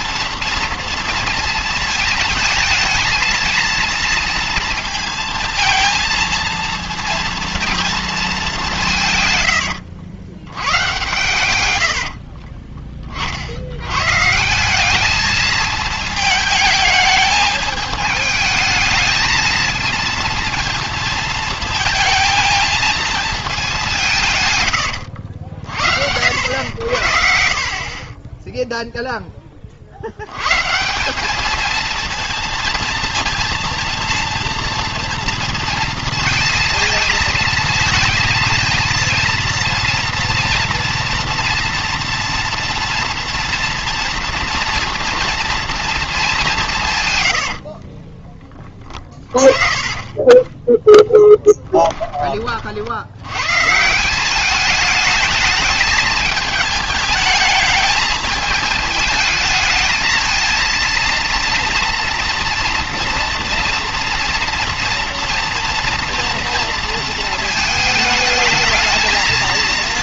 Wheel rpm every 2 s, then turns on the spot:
230, 220, 230, 230, 180, 100, 20, 180, 220, 220, 230, 220, 120, 80, 0, 130, 230, 230, 230, 230, 230, 240, 230, 160, 20, 10, 60, 210, 220, 220, 230, 230, 230, 230, 220.
none